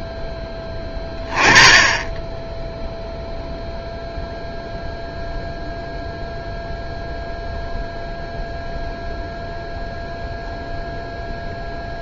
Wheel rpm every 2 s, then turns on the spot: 10, 0, 0, 0, 0, 0.
none